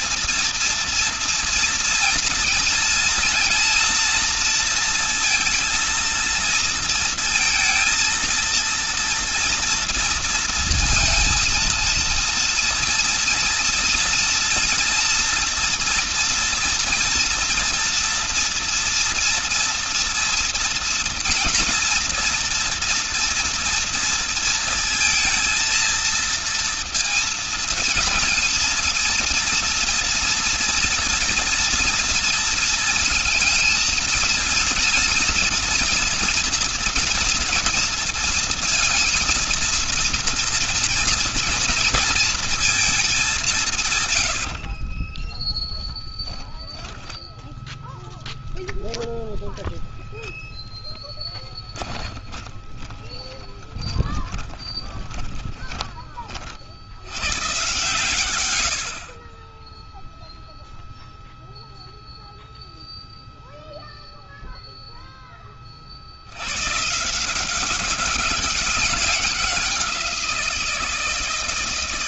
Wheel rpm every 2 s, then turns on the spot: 230, 230, 230, 230, 230, 230, 230, 230, 230, 230, 230, 240, 230, 230, 230, 230, 230, 230, 230, 230, 240, 200, 30, 0, 0, 10, 20, 20, 110, 40, 0, 0, 0, 160, 200, 160.
50-56